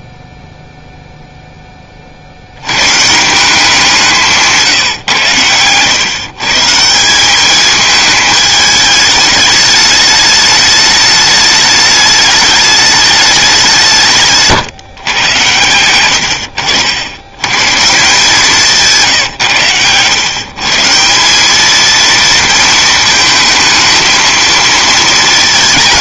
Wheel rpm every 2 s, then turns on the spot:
0, 100, 150, 150, 210, 210, 210, 140, 90, 160, 150, 230, 220.
none